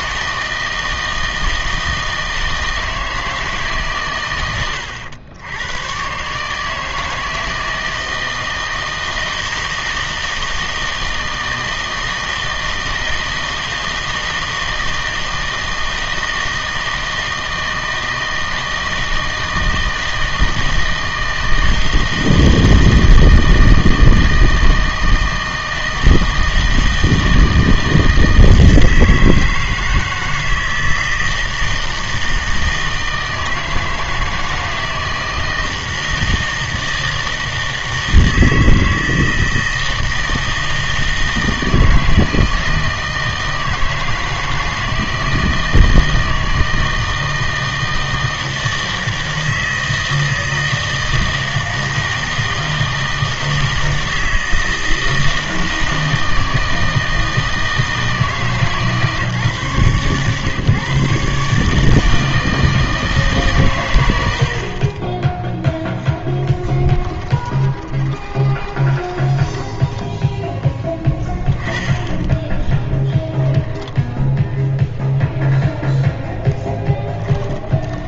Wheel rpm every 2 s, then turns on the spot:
160, 160, 90, 150, 160, 160, 160, 160, 160, 160, 160, 160, 160, 160, 160, 160, 160, 160, 160, 160, 160, 160, 160, 160, 160, 160, 160, 160, 160, 150, 130, 160, 50, 10, 10, 10, 10, 0, 20.
66-70 72-74 76-78